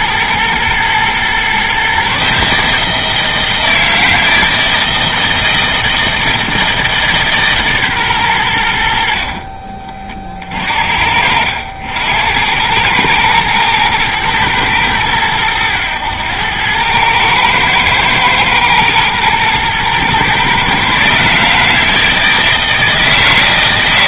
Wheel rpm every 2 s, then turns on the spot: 120, 160, 160, 160, 70, 70, 110, 110, 110, 110, 140, 160.
none